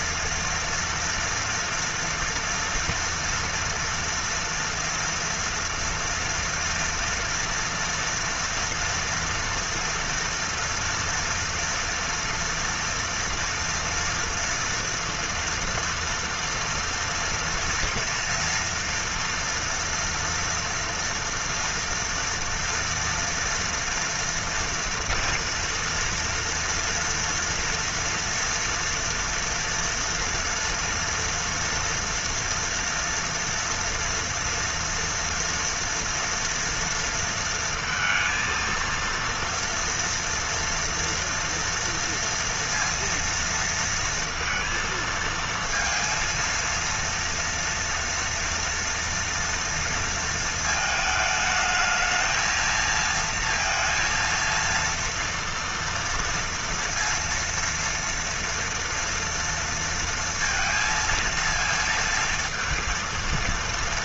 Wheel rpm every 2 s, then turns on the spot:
230, 230, 230, 230, 230, 230, 230, 230, 230, 230, 230, 230, 230, 230, 240, 230, 230, 230, 240, 230, 240, 230, 230, 230, 230, 230, 220, 230, 230, 230, 230, 230.
none